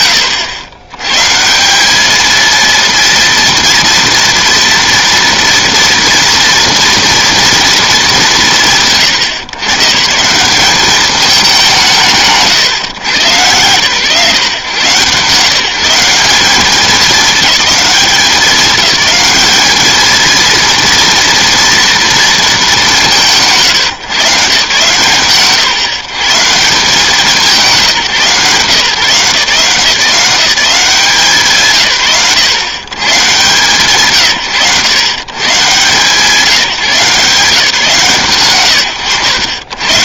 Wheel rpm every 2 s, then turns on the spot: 130, 230, 230, 230, 120, 200, 120, 140, 210, 210, 230, 190, 140, 180, 160, 160, 120, 120, 150, 120.
none